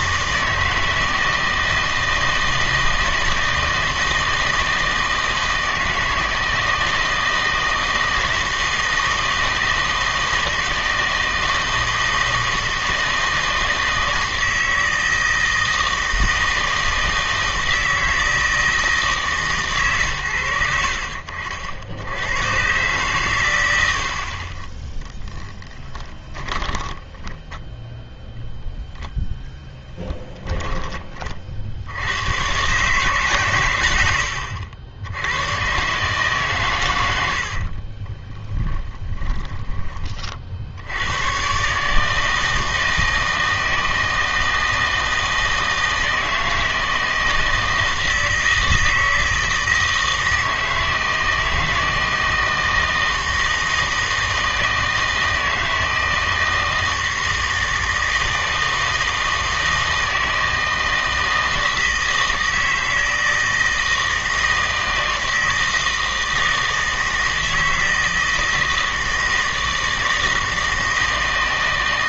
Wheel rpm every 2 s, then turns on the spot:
160, 160, 160, 160, 160, 160, 160, 160, 160, 160, 80, 120, 30, 20, 0, 10, 130, 80, 120, 10, 70, 160, 160, 160, 160, 160, 160, 160, 160, 160, 160, 160, 160, 160, 160, 160.
26-28 38-40